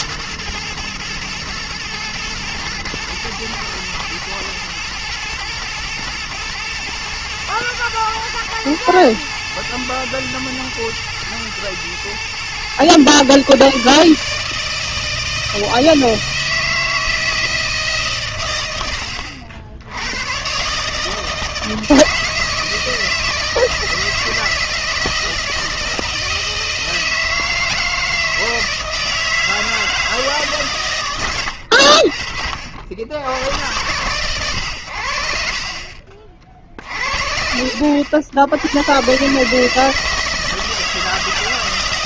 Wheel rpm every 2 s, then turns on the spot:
110, 110, 110, 110, 110, 120, 120, 160, 160, 100, 130, 160, 160, 160, 160, 140, 60, 100, 50, 90, 160.
none